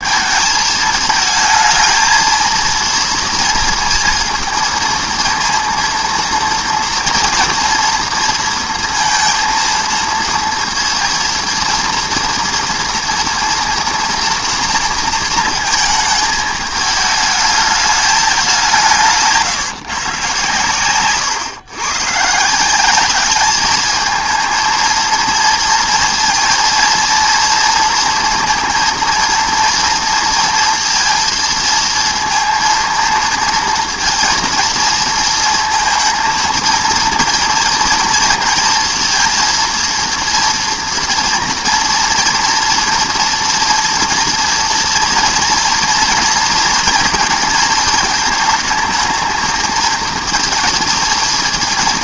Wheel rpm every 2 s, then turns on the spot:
220, 230, 230, 240, 230, 230, 230, 240, 220, 200, 130, 150, 220, 230, 230, 230, 220, 230, 230, 230, 230, 230, 230, 230, 220, 230.
none